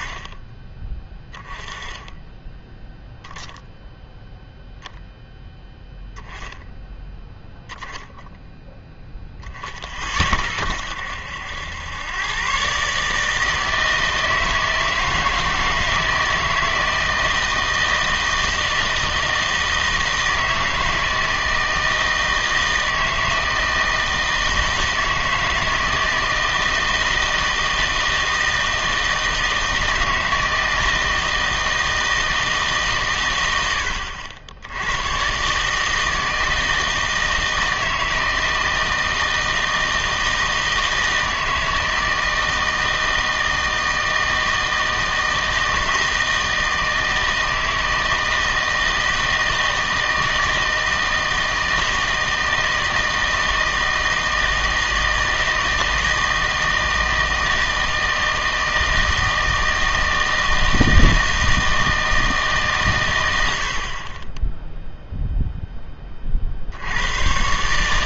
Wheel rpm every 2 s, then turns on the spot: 30, 0, 0, 0, 0, 60, 130, 160, 160, 160, 160, 160, 160, 160, 160, 160, 150, 80, 160, 160, 160, 160, 160, 160, 160, 160, 160, 160, 160, 160, 160, 150, 10, 60.
none